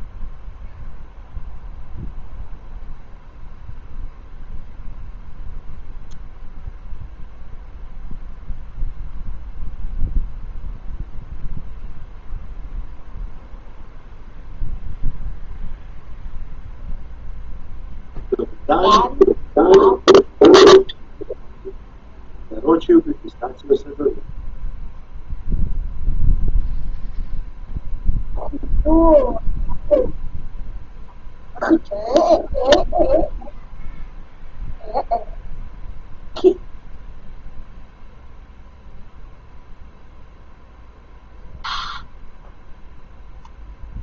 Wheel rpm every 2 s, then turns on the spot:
0, 0, 0, 0, 0, 0, 0, 0, 0, 0, 0, 0, 0, 0, 0, 0, 0, 0, 0, 0, 0, 0.
none